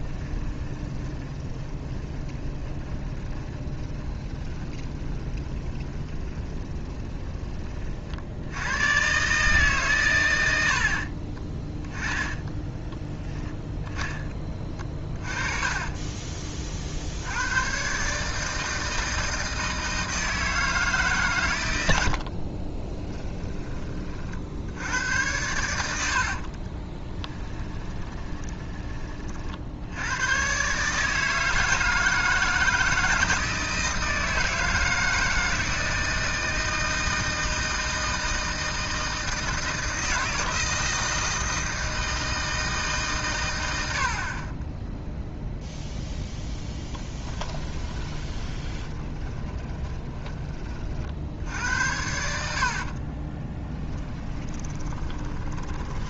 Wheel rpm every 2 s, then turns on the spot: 20, 20, 20, 20, 110, 60, 10, 30, 40, 160, 160, 30, 80, 30, 20, 140, 160, 160, 160, 160, 160, 160, 10, 10, 20, 40, 60, 20.
0-6 12-16 22-24 26-28 48-50 52-56